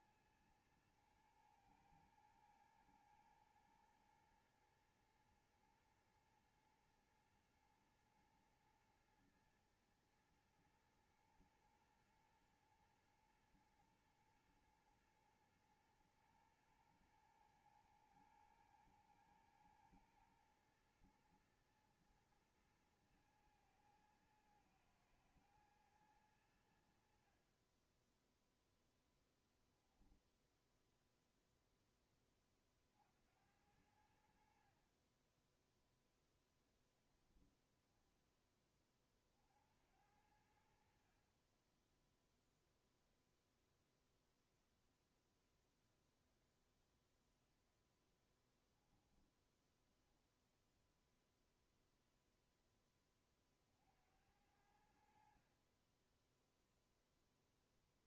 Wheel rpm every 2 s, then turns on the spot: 110, 110, 120, 120, 120, 120, 110, 110, 120, 120, 110, 110, 110, 90, 0, 0, 30, 60, 0, 10, 70, 0, 0, 0, 10, 0, 10, 70, 10.
34-36 48-50 56-58